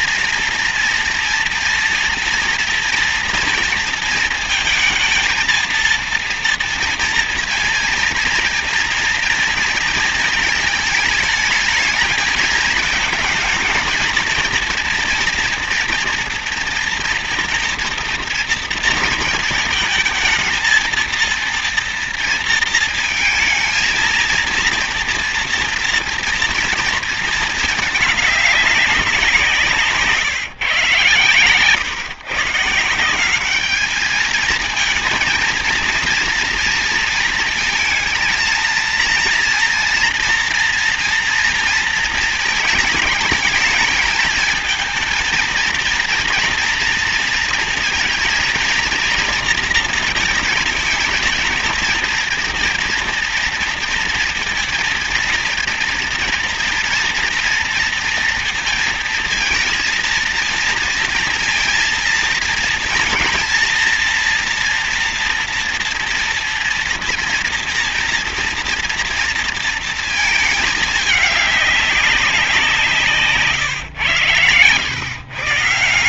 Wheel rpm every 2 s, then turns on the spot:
230, 230, 220, 230, 230, 220, 220, 230, 230, 230, 230, 230, 230, 230, 200, 130, 160, 230, 230, 230, 230, 220, 220, 230, 230, 220, 230, 230, 230, 230, 230, 230, 230, 230, 230, 220, 170, 120.
none